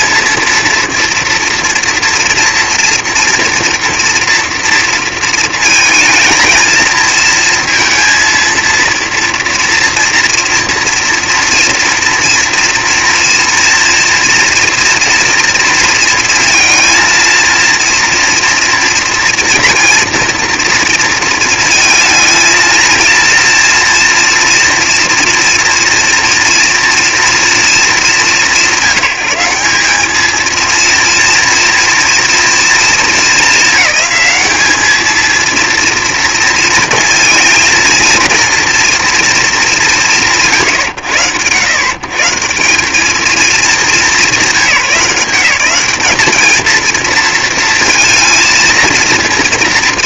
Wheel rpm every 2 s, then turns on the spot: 230, 240, 220, 230, 240, 230, 230, 230, 230, 230, 230, 230, 230, 200, 210, 230, 210, 230, 230, 140, 140, 190, 200, 230, 230.
none